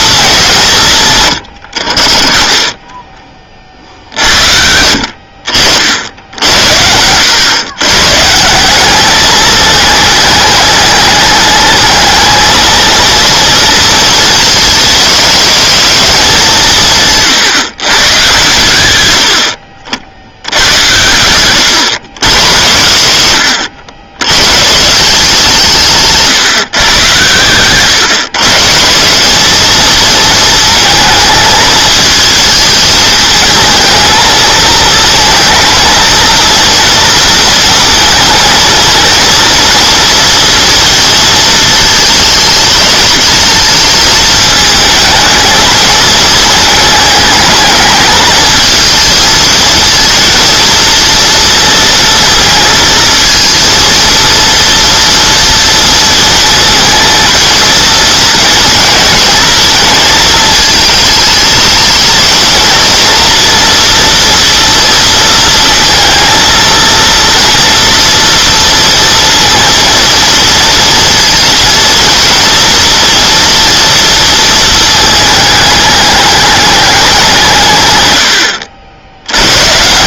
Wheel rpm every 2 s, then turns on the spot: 180, 20, 70, 70, 180, 210, 220, 210, 150, 110, 90, 90, 150, 130, 160, 220, 210, 230, 230, 230, 230, 220, 220, 220, 220, 230, 230, 230, 220, 230, 220, 230, 230, 230, 230, 230, 230, 220, 200, 80.
none